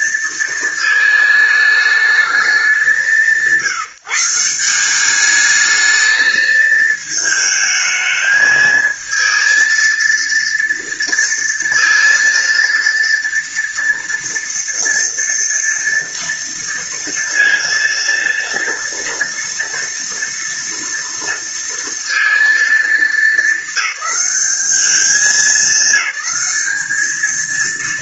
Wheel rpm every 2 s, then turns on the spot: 220, 180, 190, 220, 220, 230, 230, 230, 230, 230, 230, 220, 210, 210.
none